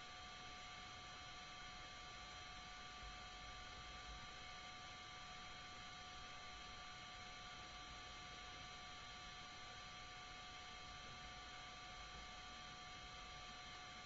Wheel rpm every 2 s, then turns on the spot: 0, 0, 0, 0, 0, 0, 0.
none